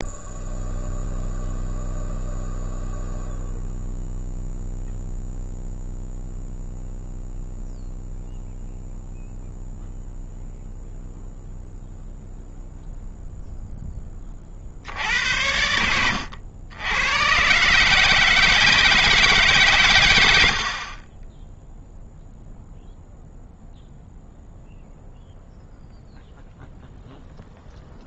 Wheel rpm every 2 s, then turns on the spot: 0, 0, 0, 0, 0, 0, 0, 50, 90, 160, 70, 0, 0, 0.
none